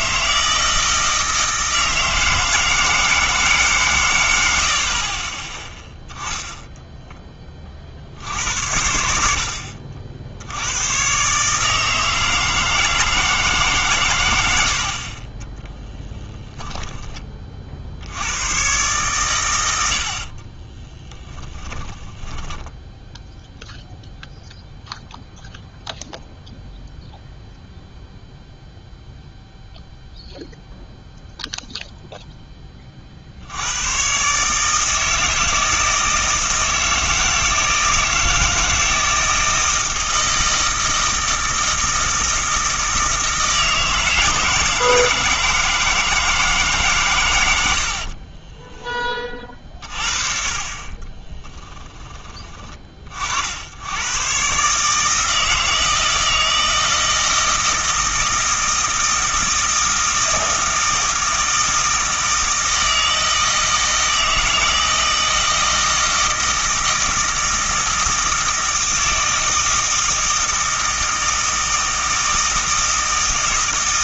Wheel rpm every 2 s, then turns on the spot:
160, 160, 80, 0, 70, 90, 160, 80, 10, 110, 40, 20, 0, 0, 0, 0, 20, 150, 160, 160, 160, 160, 160, 150, 20, 40, 20, 130, 160, 160, 160, 160, 160, 160, 160, 160, 160.
16-18 20-24 48-50